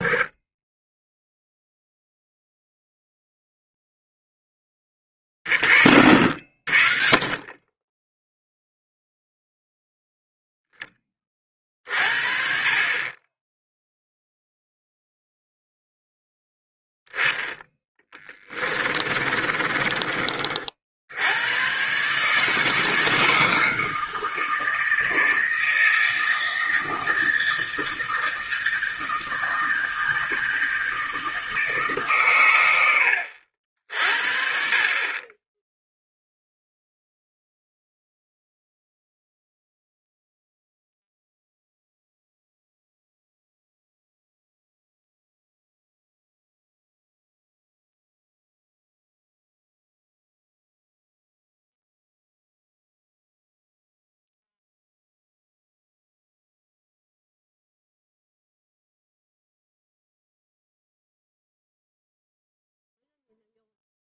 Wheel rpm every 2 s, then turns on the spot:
30, 0, 10, 50, 0, 10, 30, 0, 10, 30, 50, 160, 160, 160, 160, 160, 100, 40, 0, 0, 0, 0, 0, 0, 0, 0, 0, 0, 0, 0, 0, 0.
18-20